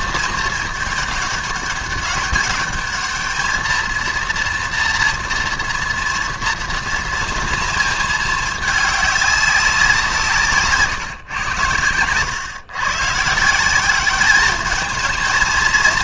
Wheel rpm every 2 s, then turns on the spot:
220, 200, 230, 230, 220, 160, 100, 200.
none